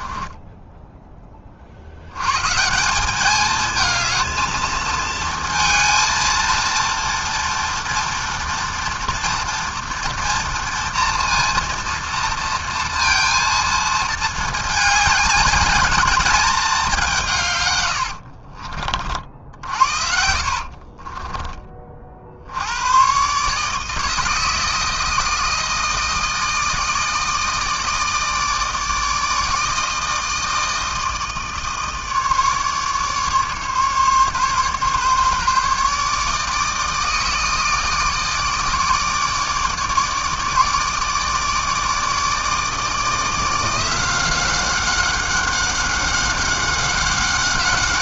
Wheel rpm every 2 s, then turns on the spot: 20, 130, 220, 230, 230, 230, 230, 220, 220, 60, 50, 80, 160, 160, 160, 160, 150, 140, 150, 150, 150, 160, 180, 190.
0-2 18-22